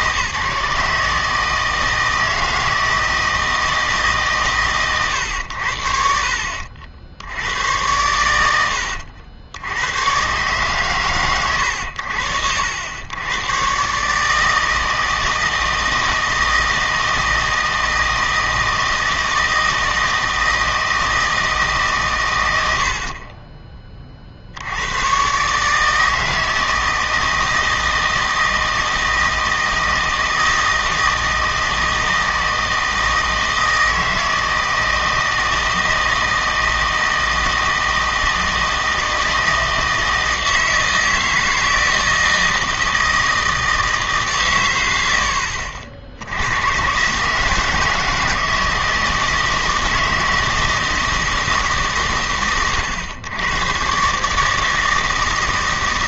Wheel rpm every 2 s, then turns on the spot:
150, 160, 120, 60, 80, 130, 80, 160, 160, 160, 160, 70, 80, 160, 160, 160, 160, 160, 160, 160, 160, 160, 110, 110, 160, 160, 110, 160.
none